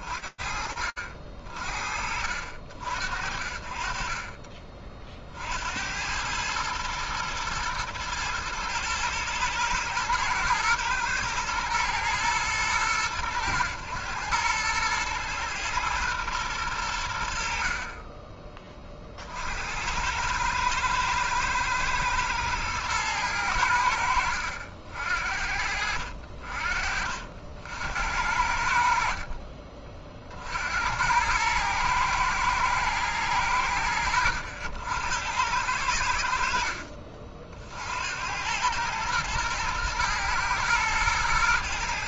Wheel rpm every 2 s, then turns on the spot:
50, 40, 80, 120, 110, 110, 110, 120, 50, 60, 110, 90, 70, 70, 40, 110, 90, 90, 60, 120, 110.
28-30